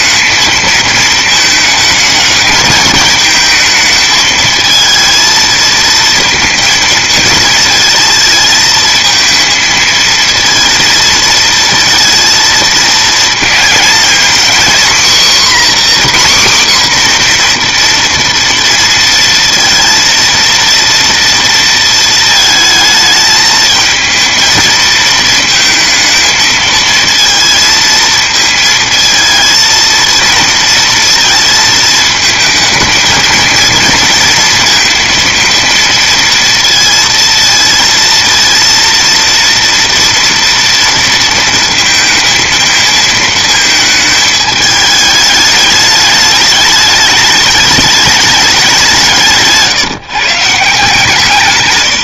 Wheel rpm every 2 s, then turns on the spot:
220, 220, 220, 220, 220, 220, 220, 260, 260, 230, 230, 220, 220, 220, 220, 230, 230, 230, 230, 230, 230, 220, 210, 210, 170, 160.
none